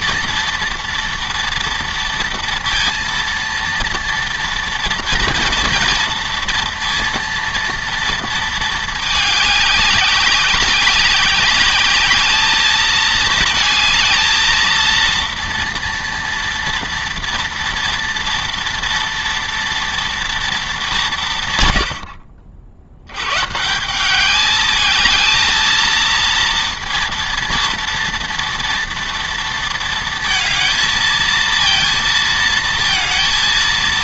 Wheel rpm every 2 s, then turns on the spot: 230, 230, 230, 230, 220, 200, 220, 230, 230, 230, 220, 80, 220, 230, 230, 220, 230.
none